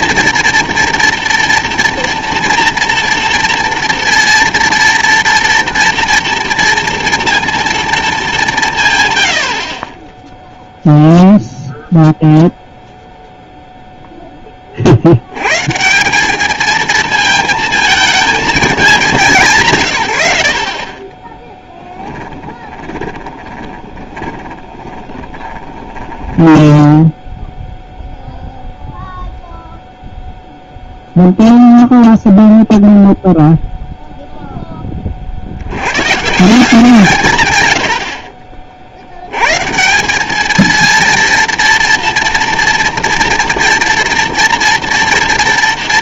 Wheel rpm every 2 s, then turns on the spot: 240, 230, 230, 230, 160, 0, 0, 10, 210, 220, 80, 10, 20, 10, 0, 0, 0, 0, 160, 40, 220, 230, 230.
20-28